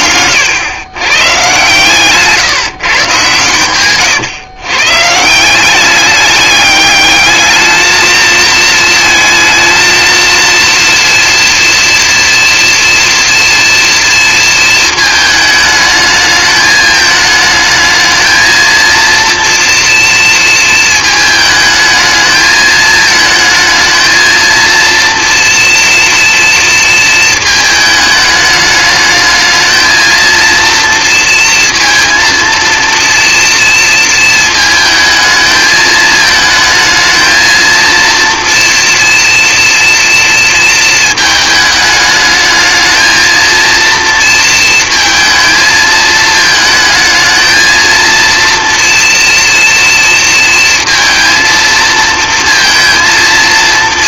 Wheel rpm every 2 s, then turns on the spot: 130, 130, 160, 210, 230, 230, 240, 220, 210, 230, 220, 220, 230, 220, 210, 230, 230, 220, 220, 230, 220, 220, 220, 220, 230, 230, 230.
none